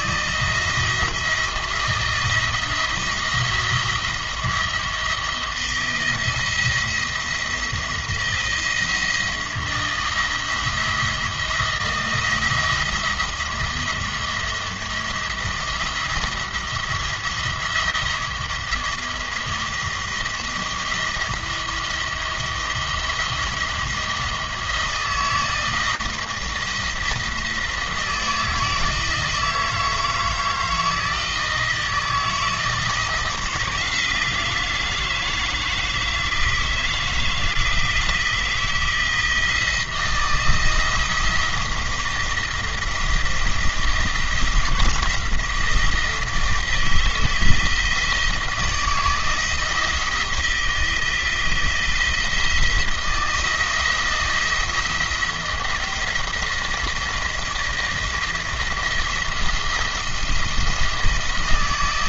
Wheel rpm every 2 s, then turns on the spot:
160, 170, 170, 170, 160, 170, 170, 170, 170, 170, 170, 170, 160, 160, 160, 160, 170, 160, 160, 160, 160, 170, 170, 160, 160, 160, 170, 170, 170, 170, 170.
none